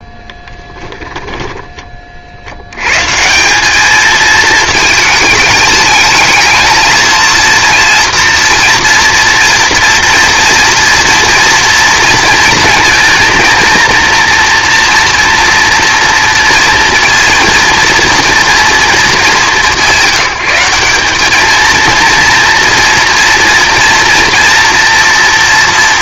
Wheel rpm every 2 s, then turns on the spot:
10, 70, 220, 220, 230, 230, 230, 230, 230, 230, 190, 230, 230.
0-2